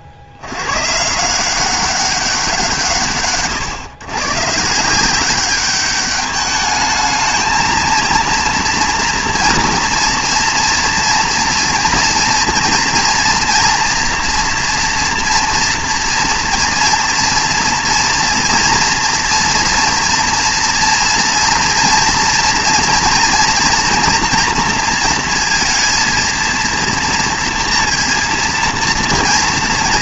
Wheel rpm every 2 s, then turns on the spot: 80, 170, 150, 210, 230, 240, 230, 230, 230, 240, 230, 230, 240, 230, 230.
none